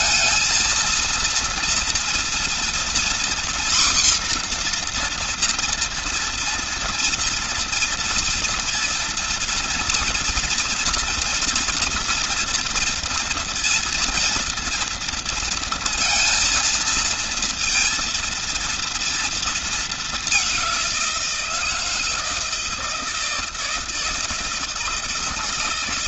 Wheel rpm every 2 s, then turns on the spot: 230, 240, 250, 240, 230, 240, 230, 230, 230, 230, 200, 160, 160.
none